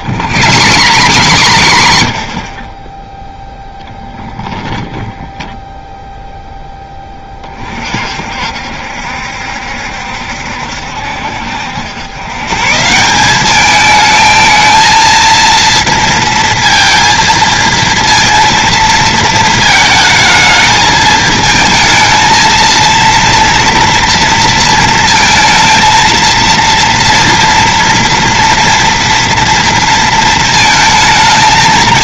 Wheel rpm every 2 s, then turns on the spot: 110, 30, 10, 10, 60, 70, 150, 220, 230, 230, 220, 230, 230, 230, 230, 220.
0-2 4-6